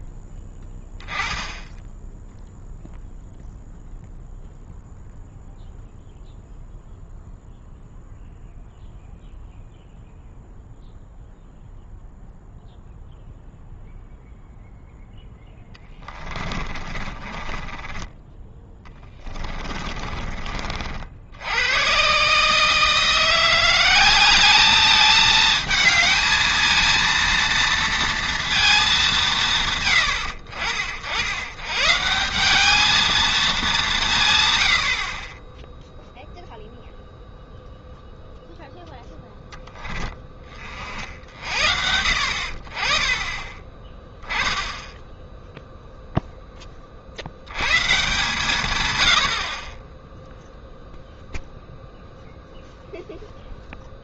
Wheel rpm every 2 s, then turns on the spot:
10, 0, 0, 0, 0, 0, 0, 0, 20, 10, 40, 160, 210, 220, 220, 70, 200, 100, 0, 0, 40, 40, 10, 20, 120, 0, 0.
16-18